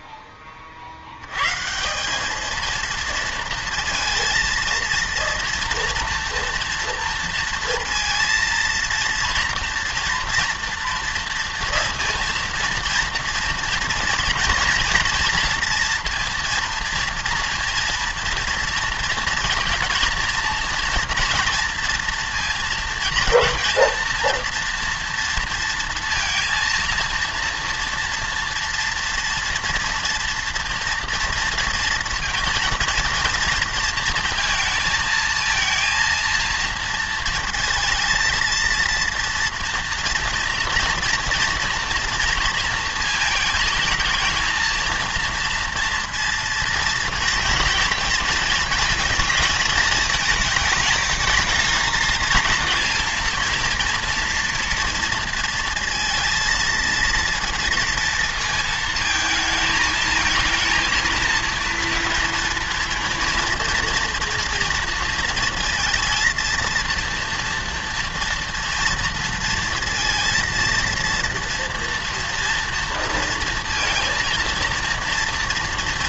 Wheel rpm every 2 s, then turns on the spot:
40, 220, 230, 230, 230, 240, 230, 230, 230, 230, 230, 230, 230, 230, 240, 230, 230, 230, 230, 230, 230, 220, 220, 230, 230, 230, 230, 230, 230, 230, 230, 240, 240, 230, 230, 230, 240, 230.
none